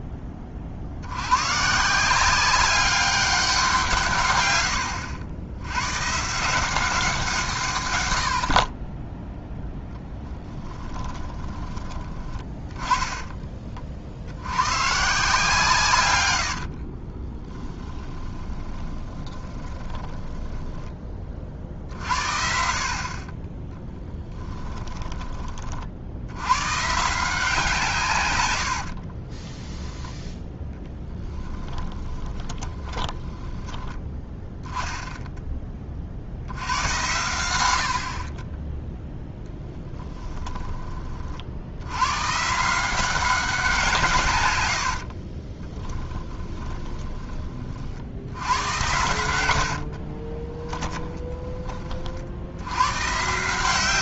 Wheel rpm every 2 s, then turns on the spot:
50, 200, 90, 180, 30, 10, 20, 130, 50, 20, 10, 50, 20, 130, 80, 10, 20, 10, 90, 10, 30, 170, 60, 30, 100, 10, 90.
4-6 10-12 16-20 24-26 28-34 44-48 50-52